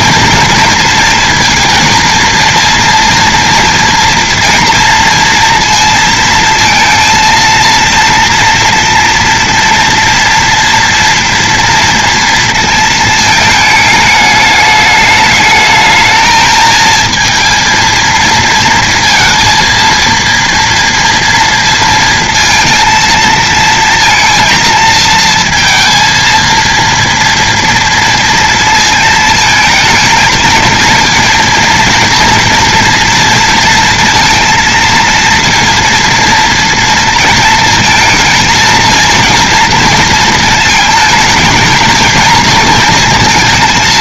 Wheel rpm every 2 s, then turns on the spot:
230, 230, 230, 230, 230, 230, 230, 210, 220, 230, 230, 230, 230, 230, 230, 220, 230, 230, 230, 230, 220, 230.
none